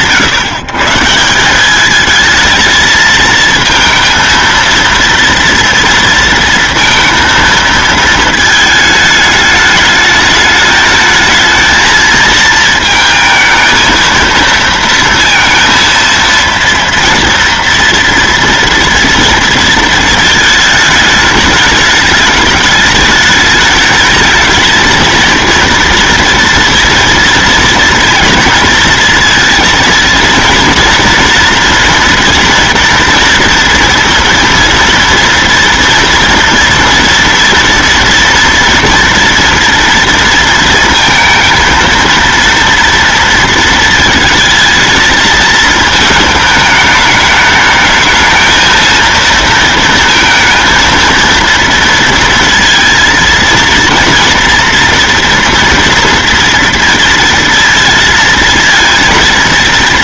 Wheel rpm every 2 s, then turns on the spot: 140, 220, 230, 230, 220, 220, 220, 230, 230, 230, 220, 210, 220, 240, 230, 230, 230, 230, 230, 230, 230, 230, 220, 210, 230, 230, 230, 230, 230, 230.
none